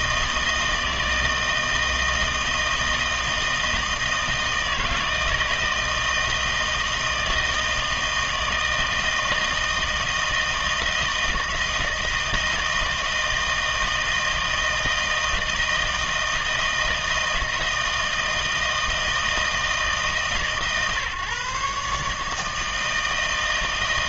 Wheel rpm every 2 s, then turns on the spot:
160, 160, 160, 160, 160, 160, 160, 160, 160, 160, 140, 160.
none